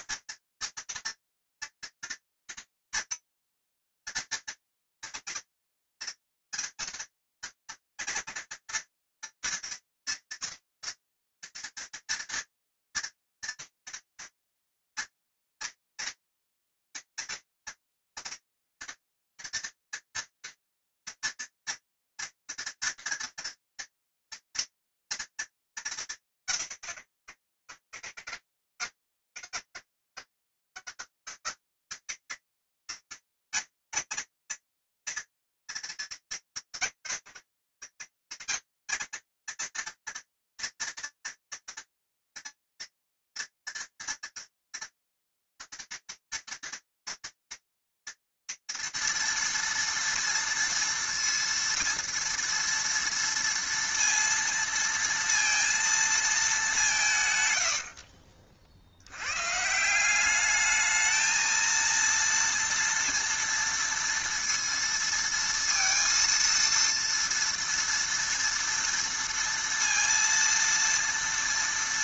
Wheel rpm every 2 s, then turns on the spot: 230, 230, 230, 230, 230, 230, 230, 230, 240, 230, 230, 230, 230, 190, 110, 160, 200, 220, 210, 160, 230, 230, 230, 230, 230, 230, 230, 230, 230, 70, 190, 230, 230, 230, 230, 230.
none